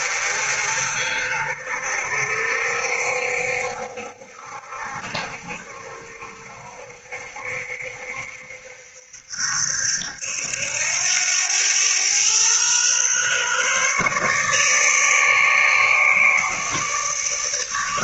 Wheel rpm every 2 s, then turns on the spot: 50, 60, 60, 60, 70, 90, 130, 150, 150.
none